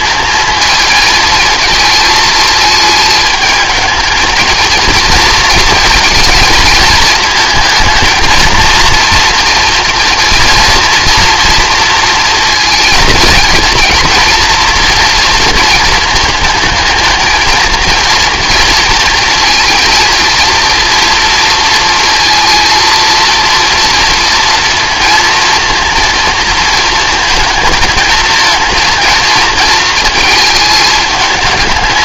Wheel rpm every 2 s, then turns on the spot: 220, 220, 230, 220, 230, 230, 230, 240, 230, 230, 230, 230, 230, 230, 230, 210.
none